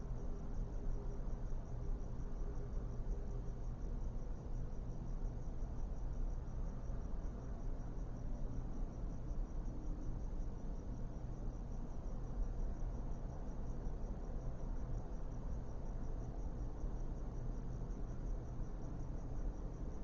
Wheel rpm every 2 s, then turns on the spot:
0, 0, 0, 0, 0, 0, 0, 0, 0, 0.
none